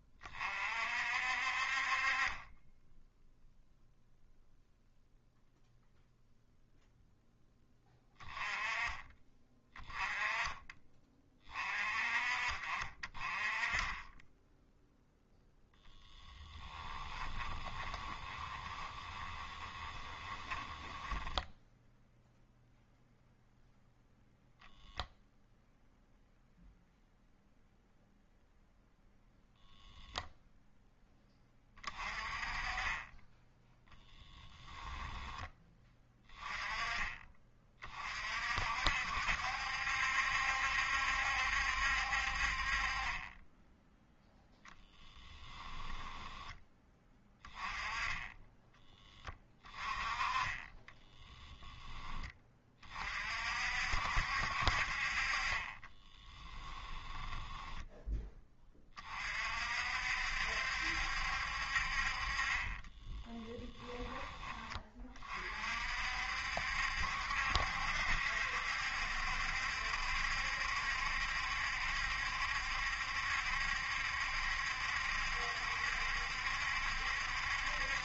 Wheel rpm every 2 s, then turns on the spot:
50, 10, 0, 0, 20, 20, 40, 0, 10, 20, 20, 0, 0, 0, 0, 0, 20, 10, 20, 60, 70, 30, 10, 20, 20, 20, 30, 50, 10, 30, 70, 20, 30, 70, 70, 70, 70, 70, 70.
16-22 44-46 50-52 56-58 62-64